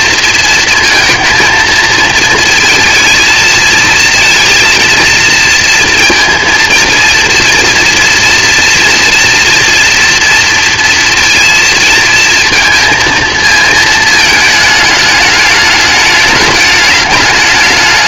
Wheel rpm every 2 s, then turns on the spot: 230, 230, 230, 230, 240, 230, 230, 220, 210.
none